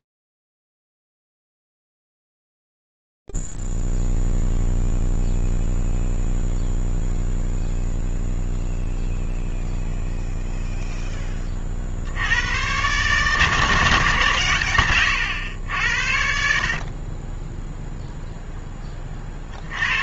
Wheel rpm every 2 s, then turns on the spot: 0, 0, 0, 0, 0, 0, 90, 140, 60, 0.
none